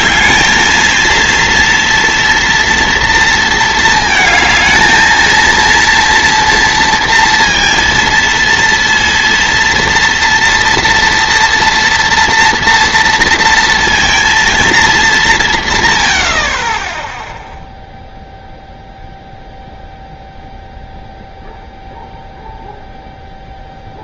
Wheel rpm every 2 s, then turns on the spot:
220, 230, 230, 230, 230, 240, 230, 220, 50, 0, 0, 0.
none